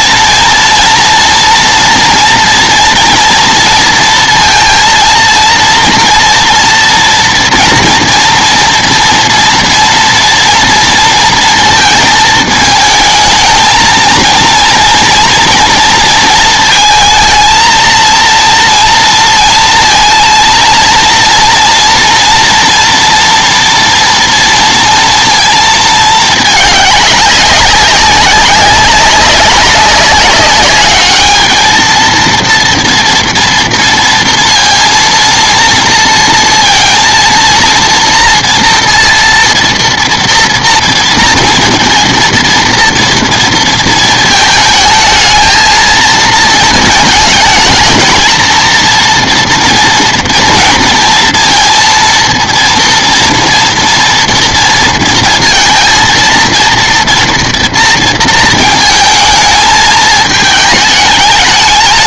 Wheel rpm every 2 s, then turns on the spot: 230, 230, 230, 230, 230, 230, 220, 230, 230, 230, 230, 230, 230, 200, 200, 210, 240, 230, 230, 230, 230, 230, 220, 220, 230, 230, 230, 230, 230, 220, 210.
none